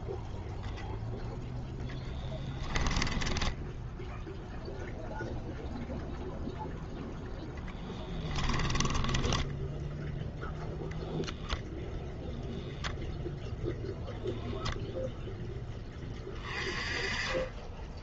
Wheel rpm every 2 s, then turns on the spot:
0, 10, 0, 0, 20, 0, 0, 0, 20.
2-4 8-10